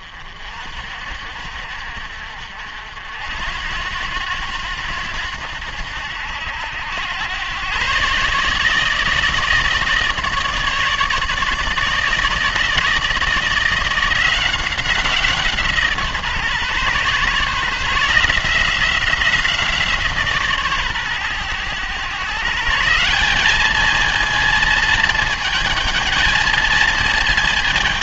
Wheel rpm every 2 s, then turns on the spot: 60, 70, 90, 90, 150, 160, 160, 180, 140, 170, 140, 160, 220, 220.
none